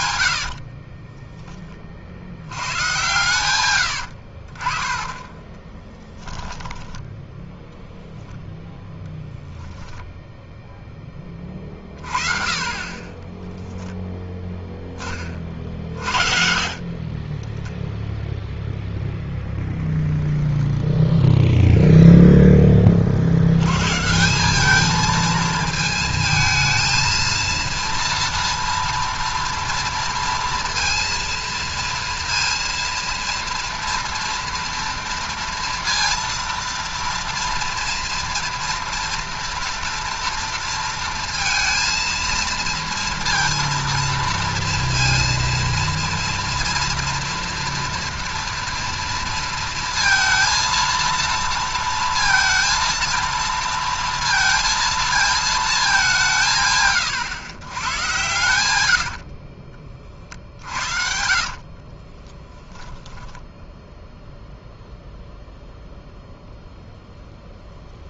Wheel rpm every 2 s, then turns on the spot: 50, 100, 40, 10, 10, 0, 30, 10, 40, 0, 0, 10, 190, 220, 230, 230, 230, 230, 230, 230, 230, 230, 230, 230, 230, 230, 230, 230, 150, 110, 50, 10, 0, 0.
0-2 60-64